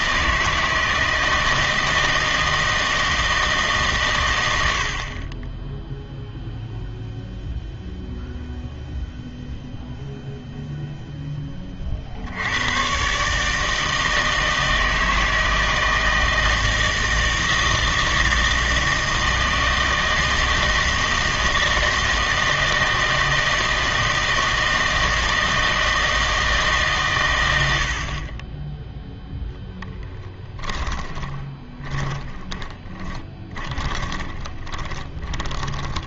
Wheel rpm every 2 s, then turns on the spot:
160, 160, 70, 0, 0, 0, 110, 160, 160, 160, 160, 160, 160, 150, 10, 20, 20, 20.
30-36